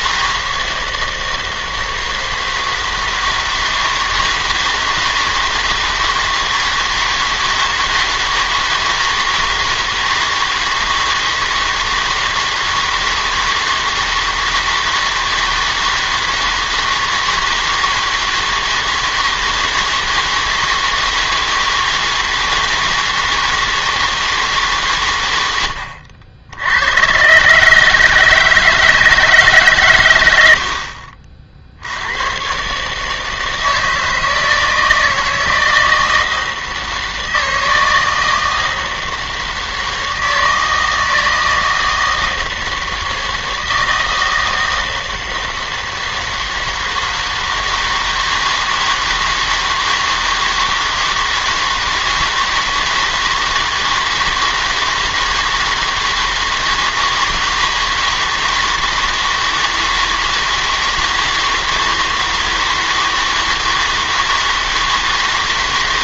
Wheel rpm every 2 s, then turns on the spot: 160, 160, 160, 160, 160, 160, 160, 160, 160, 160, 160, 160, 150, 80, 160, 80, 120, 160, 160, 160, 160, 160, 160, 160, 160, 160, 160, 160, 160, 160, 160, 160, 160.
none